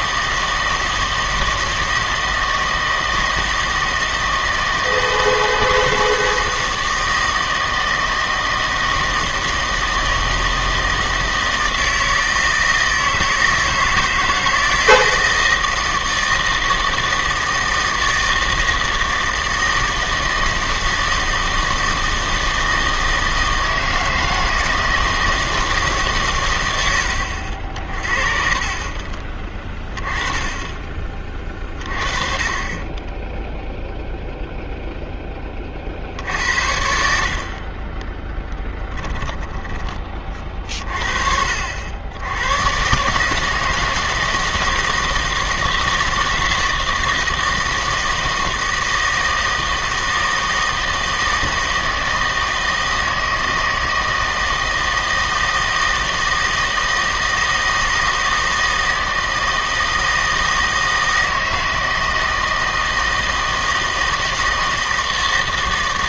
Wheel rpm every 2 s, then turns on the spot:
160, 160, 160, 160, 160, 160, 160, 160, 160, 160, 160, 160, 160, 100, 40, 10, 20, 0, 70, 10, 40, 110, 160, 160, 160, 160, 160, 160, 160, 160, 160, 160, 160.
28-30 38-40